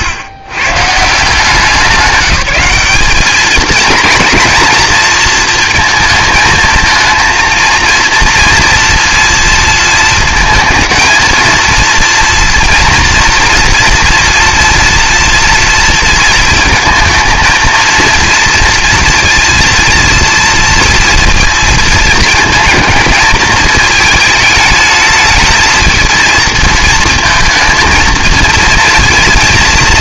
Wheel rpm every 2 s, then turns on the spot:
140, 200, 230, 230, 240, 230, 230, 230, 230, 230, 230, 220, 220, 230, 230.
none